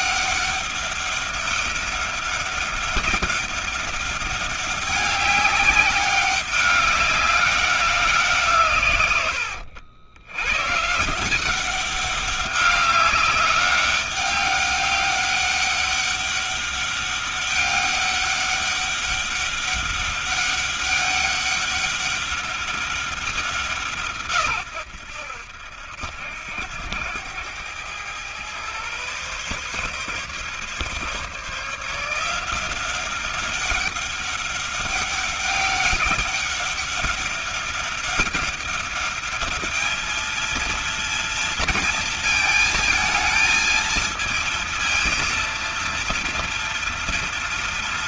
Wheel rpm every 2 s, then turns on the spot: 200, 200, 200, 190, 140, 130, 200, 200, 200, 200, 200, 200, 100, 90, 120, 140, 180, 200, 200, 200, 230, 220, 220, 230.
none